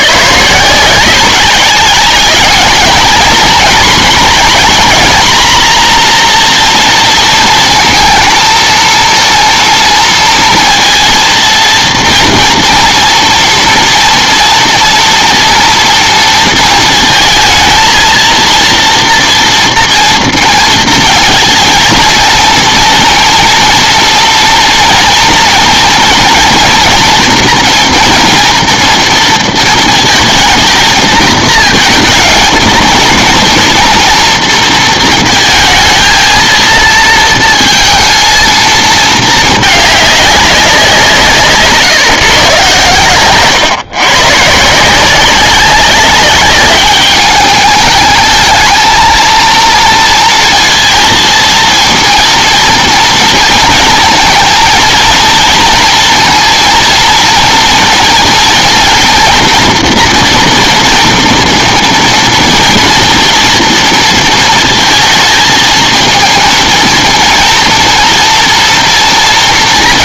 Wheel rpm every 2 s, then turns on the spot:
150, 220, 240, 230, 230, 230, 230, 230, 230, 230, 230, 230, 230, 240, 230, 230, 230, 230, 230, 230, 190, 140, 160, 200, 220, 230, 230, 230, 230, 230, 230, 240, 230, 230, 240.
none